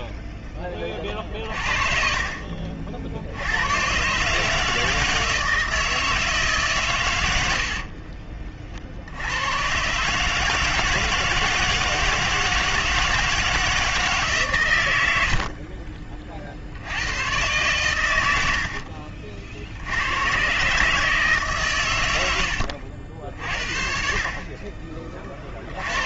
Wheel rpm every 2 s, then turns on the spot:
10, 30, 150, 150, 50, 160, 160, 150, 50, 70, 130, 80, 30.
none